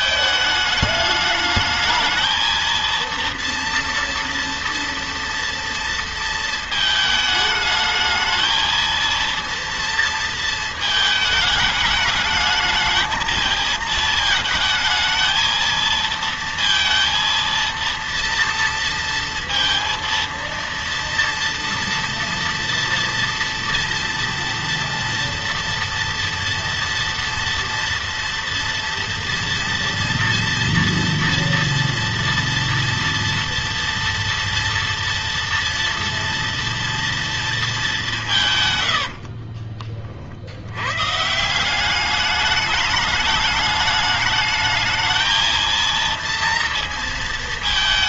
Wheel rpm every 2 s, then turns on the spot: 210, 220, 230, 220, 220, 230, 210, 220, 230, 230, 230, 230, 230, 230, 230, 230, 240, 230, 230, 130, 80, 210, 210, 230.
none